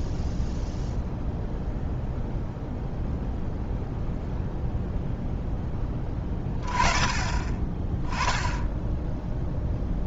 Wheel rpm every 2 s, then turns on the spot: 0, 0, 0, 20, 10.
none